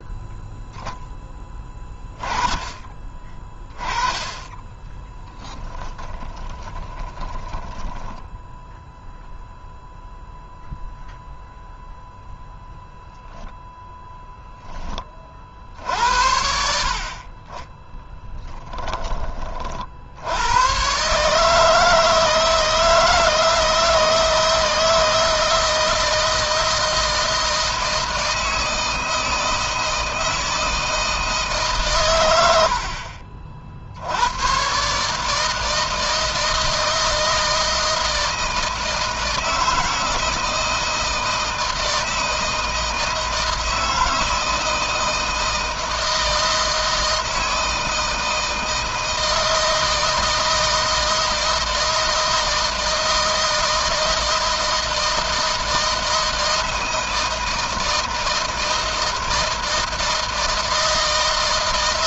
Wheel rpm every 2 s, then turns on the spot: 0, 20, 10, 20, 0, 0, 0, 20, 40, 10, 120, 160, 160, 160, 160, 160, 70, 130, 160, 160, 160, 160, 160, 160, 160, 160, 160, 160, 160, 160, 160.
4-8